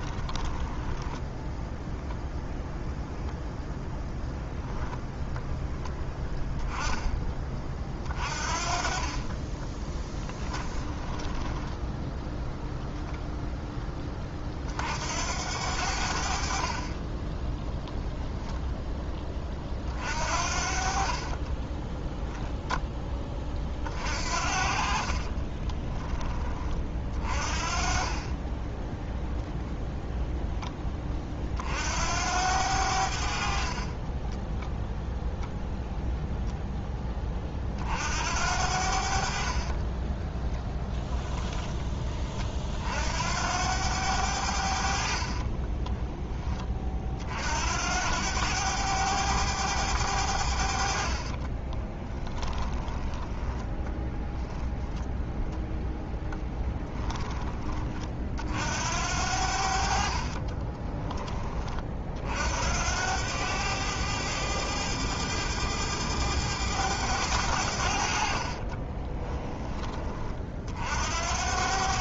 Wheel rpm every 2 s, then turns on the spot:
10, 0, 0, 10, 30, 20, 0, 60, 30, 20, 50, 10, 40, 40, 10, 20, 70, 0, 10, 70, 20, 60, 60, 40, 100, 60, 10, 0, 10, 70, 20, 80, 100, 100, 20, 60.
0-2 10-12 20-22 24-26 40-42 50-54 60-62 68-70